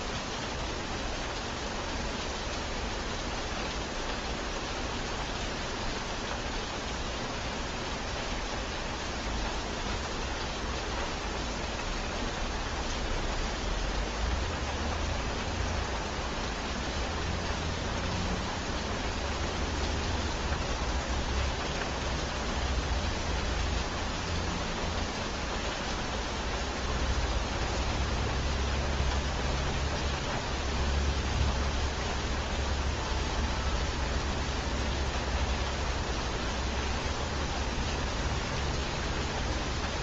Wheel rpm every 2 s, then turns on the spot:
0, 0, 0, 0, 0, 0, 0, 0, 0, 0, 0, 0, 0, 0, 0, 0, 0, 0, 0, 0.
none